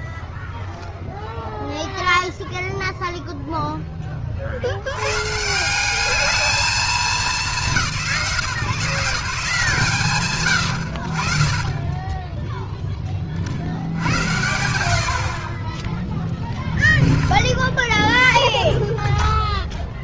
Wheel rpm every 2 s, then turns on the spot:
0, 120, 210, 160, 60, 10, 80, 20, 10, 0.
none